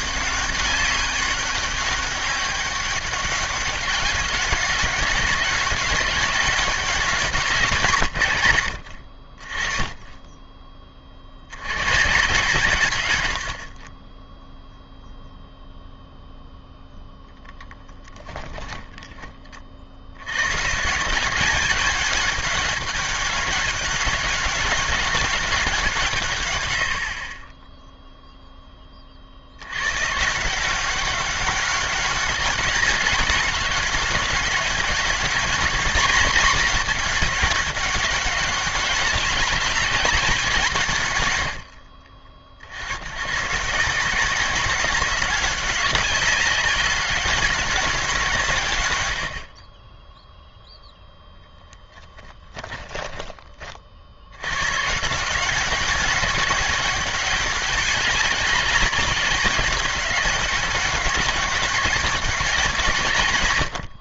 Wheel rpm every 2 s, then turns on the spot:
200, 200, 190, 200, 100, 10, 140, 0, 0, 10, 140, 210, 200, 110, 10, 180, 200, 200, 220, 190, 170, 60, 200, 190, 130, 0, 10, 120, 200, 200, 190, 180.
52-54